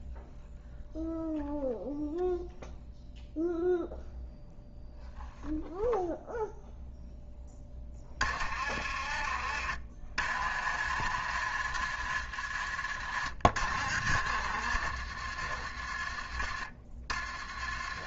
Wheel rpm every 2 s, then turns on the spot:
0, 0, 0, 0, 40, 50, 50, 60, 30.
none